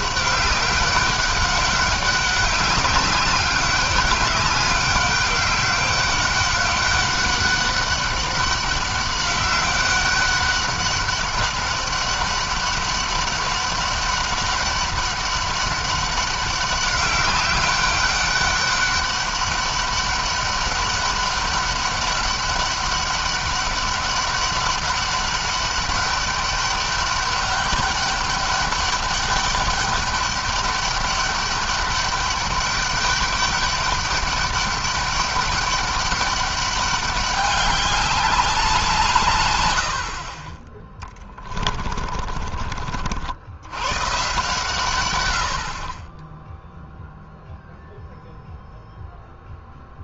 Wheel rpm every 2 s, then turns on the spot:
200, 190, 200, 200, 200, 200, 200, 200, 200, 200, 200, 200, 200, 200, 200, 200, 200, 200, 200, 170, 20, 50, 130, 0, 0.
40-42